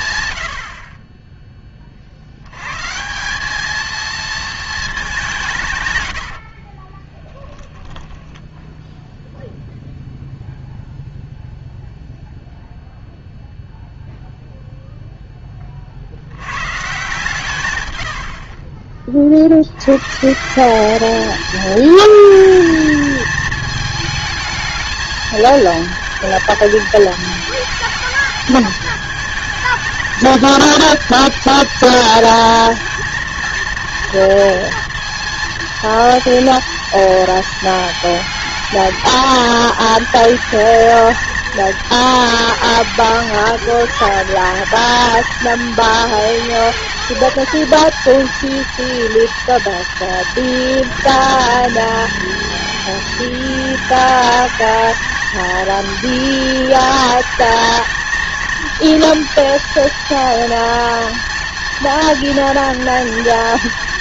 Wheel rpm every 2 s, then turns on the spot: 50, 120, 220, 30, 0, 0, 0, 0, 120, 40, 190, 220, 220, 220, 220, 220, 230, 230, 230, 220, 220, 220, 220, 220, 230, 230, 220, 220, 220, 220, 230, 230.
6-8